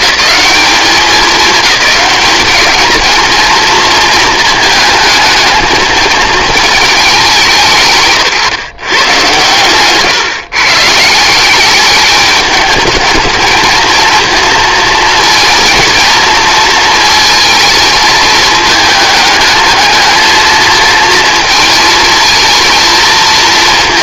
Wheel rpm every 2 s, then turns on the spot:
210, 210, 230, 220, 140, 150, 200, 230, 230, 220, 220, 220.
none